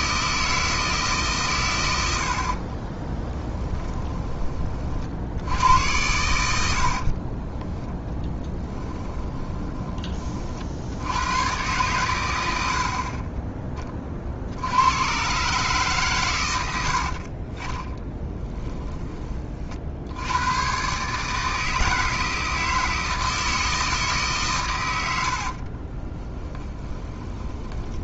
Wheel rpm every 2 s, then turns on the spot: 160, 30, 30, 80, 10, 60, 80, 80, 90, 20, 120, 160, 110, 10.
2-4 6-10 26-28